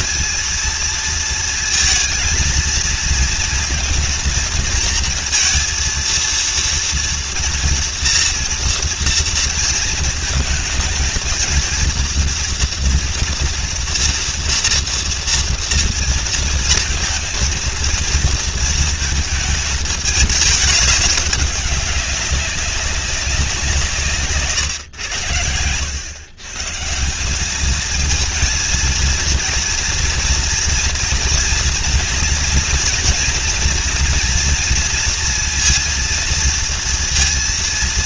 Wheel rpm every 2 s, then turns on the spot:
230, 230, 230, 230, 230, 220, 230, 230, 230, 230, 210, 190, 120, 150, 230, 230, 230, 230, 230.
none